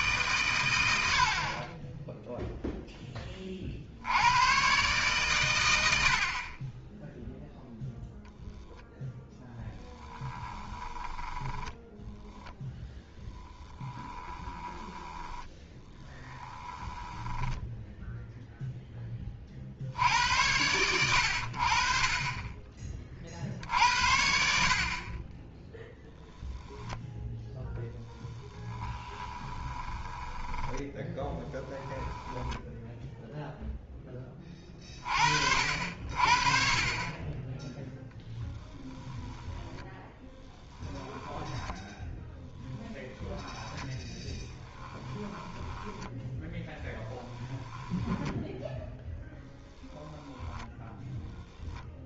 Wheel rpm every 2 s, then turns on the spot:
90, 10, 120, 20, 0, 10, 0, 10, 10, 10, 90, 20, 50, 0, 20, 10, 0, 30, 30, 10, 10, 10, 10, 10, 0, 0.
10-12 14-18 28-32 38-42 44-48